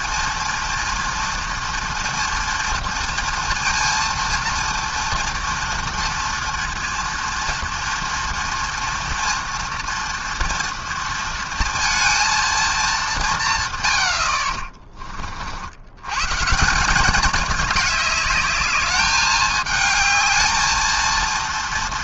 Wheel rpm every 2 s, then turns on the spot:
230, 230, 230, 230, 230, 230, 210, 30, 180, 210, 230.
14-16